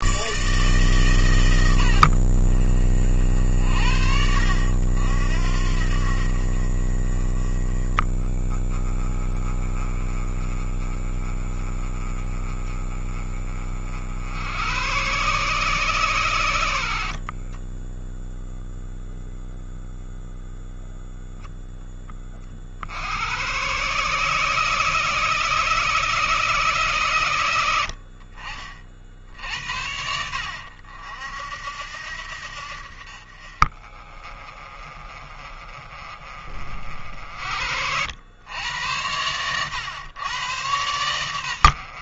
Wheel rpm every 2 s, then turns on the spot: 140, 50, 70, 40, 30, 30, 30, 110, 90, 0, 0, 60, 160, 150, 50, 60, 60, 30, 50, 90, 100.
none